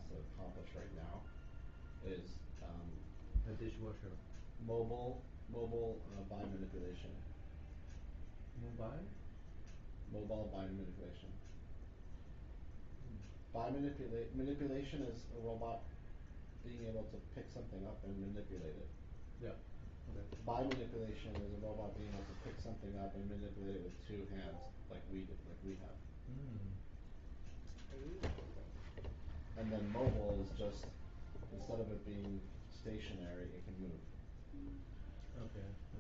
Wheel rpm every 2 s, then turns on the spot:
0, 0, 0, 0, 0, 0, 0, 0, 0, 0, 0, 0, 0, 0, 0, 0, 0, 0.
none